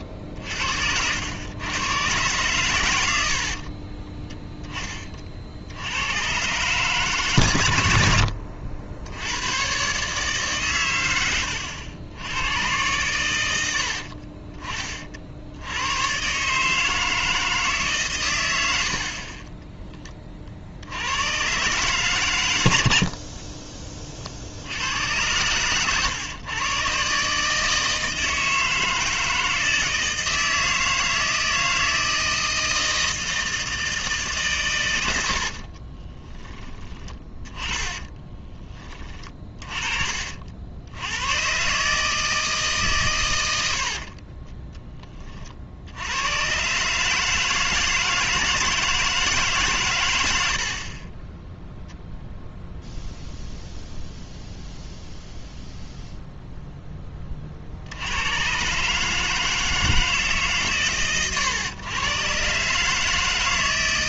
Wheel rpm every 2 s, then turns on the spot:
60, 110, 20, 130, 60, 130, 100, 40, 150, 70, 70, 90, 80, 130, 160, 160, 160, 120, 20, 30, 80, 150, 10, 130, 160, 60, 0, 0, 0, 130, 130, 140.
36-40 50-52